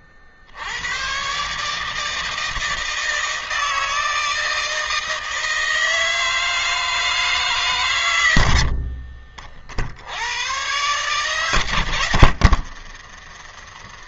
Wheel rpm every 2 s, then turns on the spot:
70, 160, 160, 160, 90, 110, 90.
12-14